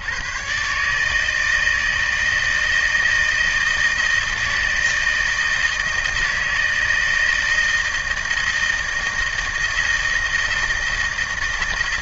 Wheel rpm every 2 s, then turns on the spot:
130, 160, 160, 160, 160, 160.
none